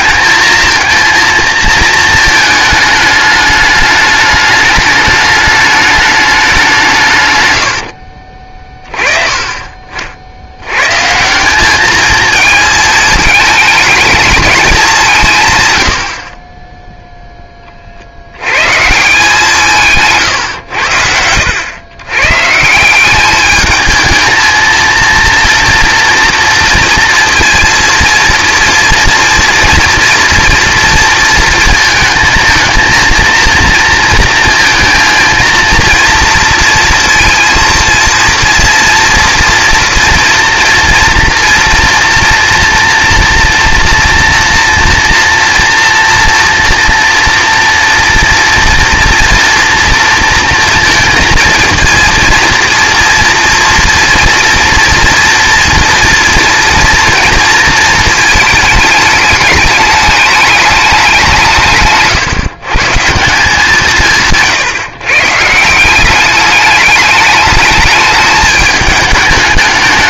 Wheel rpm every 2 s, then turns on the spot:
230, 210, 210, 180, 30, 130, 220, 200, 10, 150, 90, 180, 230, 230, 240, 230, 230, 230, 230, 230, 230, 230, 240, 230, 230, 230, 230, 230, 230, 210, 200, 150, 150, 210, 210.
none